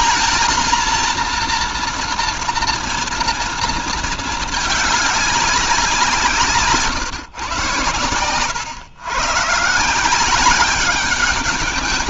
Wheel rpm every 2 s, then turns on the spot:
230, 230, 210, 150, 120, 190.
none